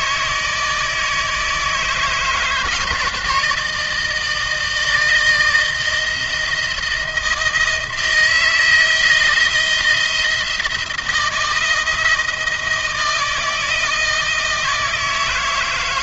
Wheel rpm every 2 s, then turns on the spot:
160, 160, 160, 170, 170, 170, 160, 160.
none